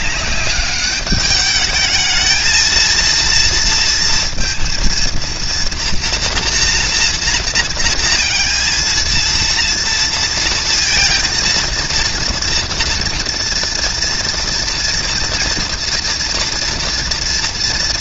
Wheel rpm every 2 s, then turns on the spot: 200, 230, 230, 240, 230, 230, 230, 230, 230.
none